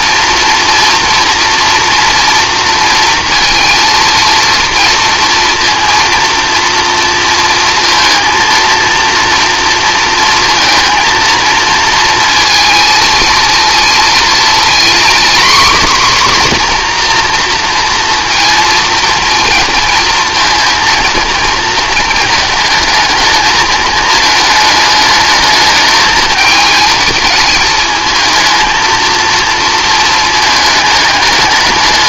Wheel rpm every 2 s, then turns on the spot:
230, 230, 230, 230, 230, 230, 230, 230, 260, 230, 230, 220, 220, 220, 220, 220.
none